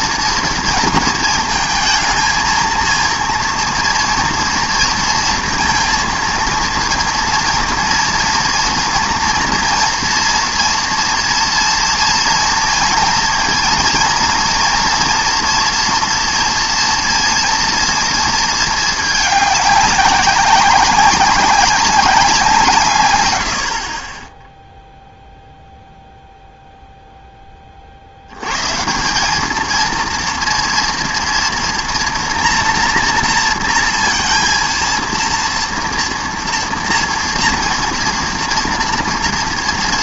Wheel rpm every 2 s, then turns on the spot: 230, 230, 230, 230, 230, 230, 230, 230, 230, 220, 190, 170, 10, 0, 130, 230, 230, 230, 230, 240.
none